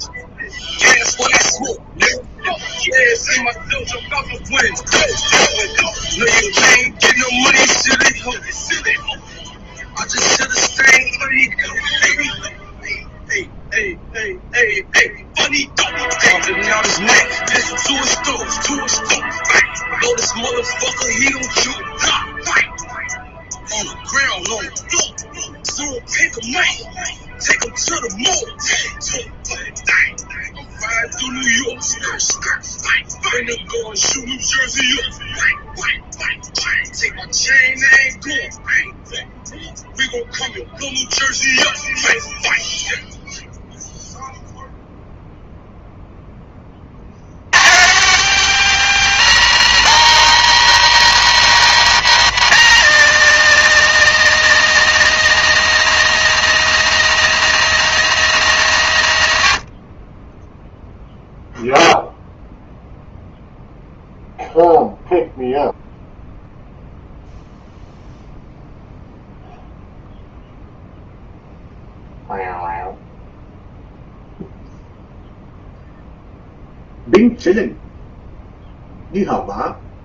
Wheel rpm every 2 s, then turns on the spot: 0, 0, 0, 0, 0, 0, 0, 0, 0, 0, 0, 0, 0, 0, 0, 0, 0, 0, 0, 0, 0, 0, 0, 70, 200, 200, 200, 200, 200, 120, 0, 0, 0, 0, 0, 0, 0, 0, 0, 0.
none